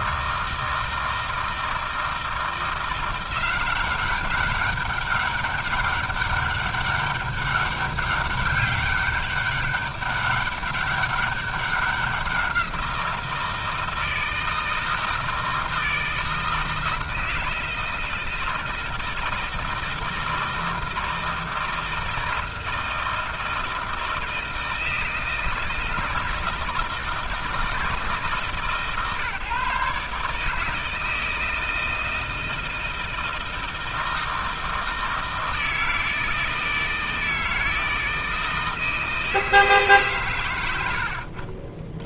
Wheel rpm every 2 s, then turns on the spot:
160, 170, 200, 200, 200, 200, 170, 160, 160, 160, 160, 160, 160, 160, 140, 160, 160, 160, 160, 160, 70.
40-42